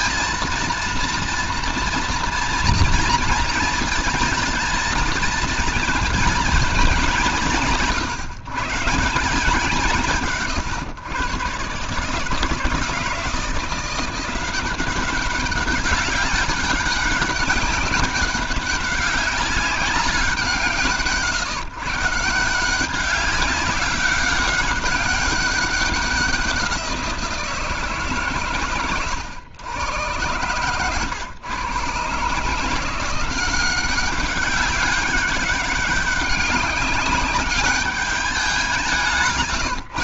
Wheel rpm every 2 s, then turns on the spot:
230, 230, 230, 210, 170, 130, 150, 190, 190, 200, 170, 180, 200, 180, 110, 120, 170, 190, 190, 190.
none